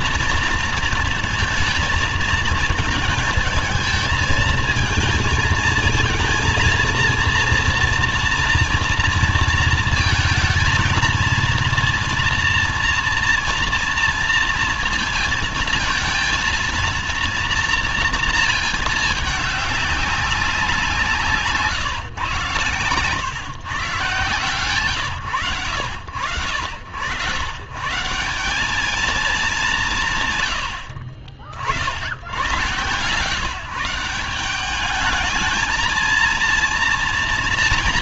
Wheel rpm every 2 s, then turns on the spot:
230, 220, 230, 240, 230, 230, 230, 230, 230, 220, 180, 120, 130, 90, 210, 70, 120, 200, 230.
none